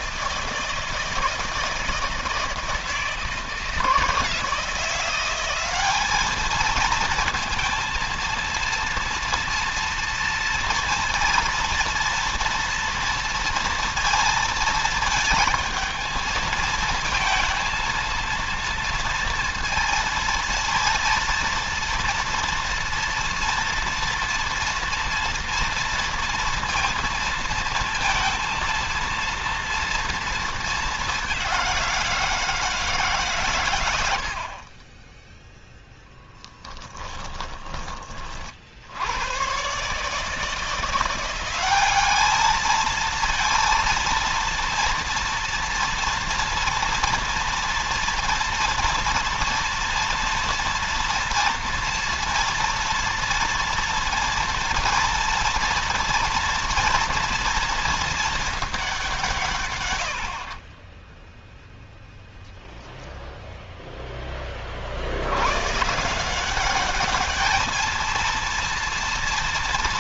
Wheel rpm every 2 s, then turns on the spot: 160, 160, 170, 220, 230, 230, 230, 220, 220, 230, 230, 230, 230, 230, 230, 210, 160, 30, 10, 70, 170, 220, 230, 230, 230, 230, 230, 230, 230, 200, 30, 0, 60, 200, 230.
36-38 60-62